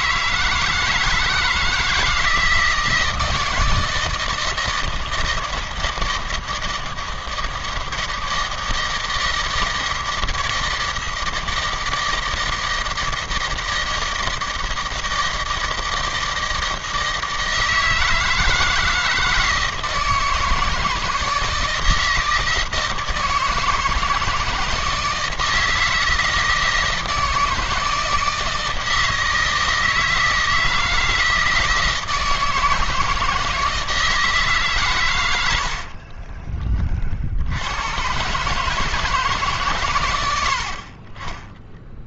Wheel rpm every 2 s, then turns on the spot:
160, 160, 160, 160, 160, 160, 160, 160, 160, 160, 160, 160, 160, 160, 160, 160, 160, 150, 30, 140, 70.
none